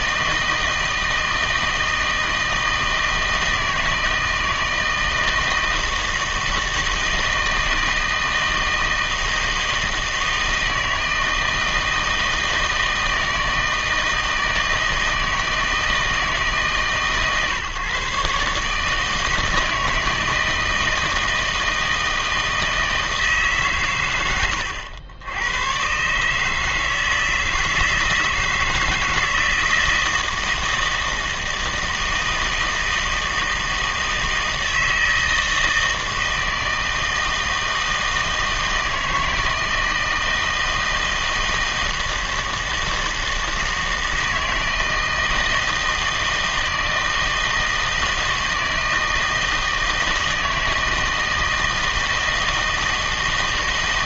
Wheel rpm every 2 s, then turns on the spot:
160, 160, 160, 160, 160, 160, 160, 160, 150, 150, 160, 160, 90, 160, 160, 160, 160, 160, 160, 160, 160, 160, 160, 160, 160, 160, 160.
none